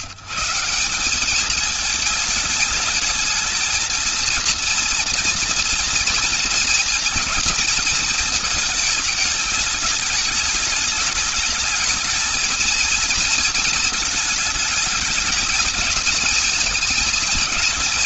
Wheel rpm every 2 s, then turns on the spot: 170, 220, 230, 230, 220, 210, 220, 220, 220.
none